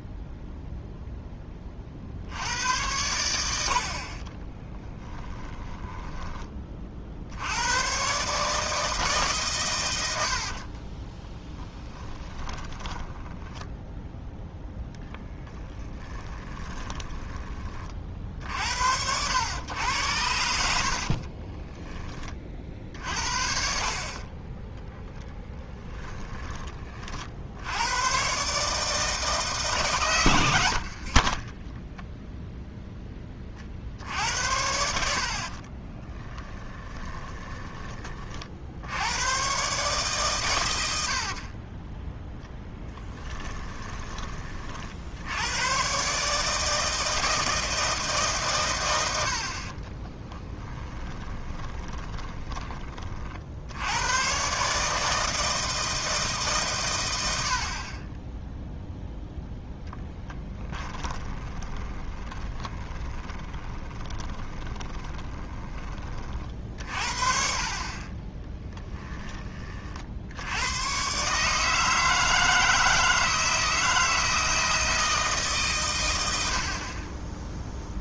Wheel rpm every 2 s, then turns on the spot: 0, 100, 20, 40, 160, 30, 20, 0, 20, 70, 60, 50, 20, 30, 150, 70, 0, 80, 20, 70, 90, 10, 50, 160, 110, 10, 30, 150, 120, 0, 10, 20, 30, 50, 10, 110, 160, 160, 60.
4-6 10-14 16-18 30-32 36-38 40-44 50-52 60-66 68-70